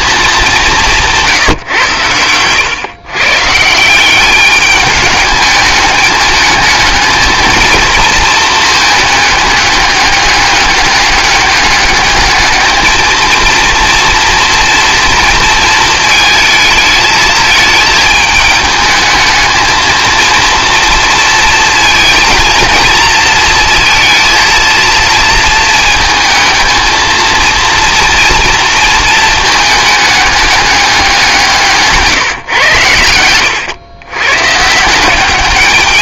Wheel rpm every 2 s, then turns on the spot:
180, 120, 210, 220, 220, 200, 220, 230, 220, 220, 230, 220, 230, 220, 220, 200, 100, 160.
0-2